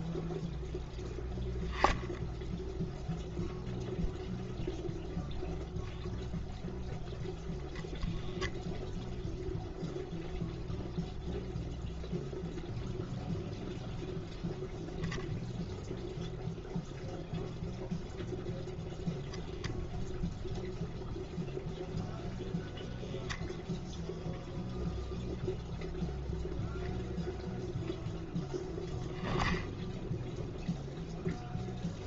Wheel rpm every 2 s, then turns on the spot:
0, 0, 0, 0, 0, 0, 0, 0, 0, 0, 0, 0, 0, 0, 0, 0.
none